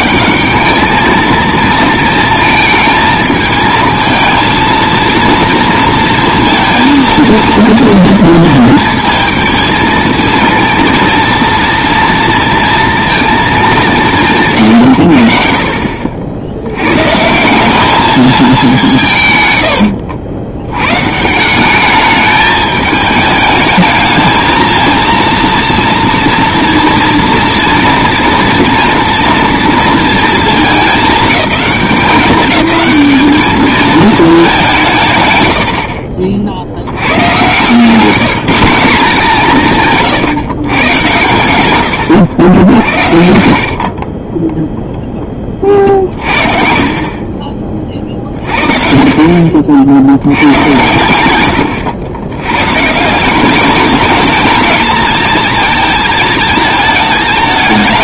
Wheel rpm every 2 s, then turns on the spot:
210, 220, 220, 230, 230, 230, 230, 140, 90, 210, 90, 210, 220, 230, 230, 220, 210, 210, 80, 200, 120, 80, 0, 40, 40, 100, 100, 220, 220.
42-44